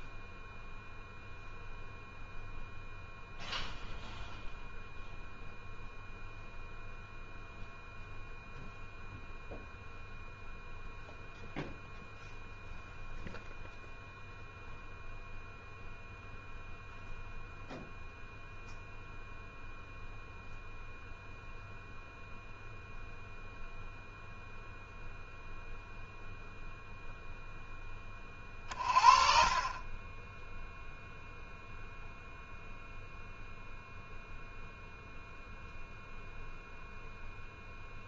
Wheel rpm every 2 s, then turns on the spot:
0, 0, 0, 0, 0, 0, 0, 0, 0, 0, 0, 0, 0, 0, 30, 0, 0, 0, 0.
none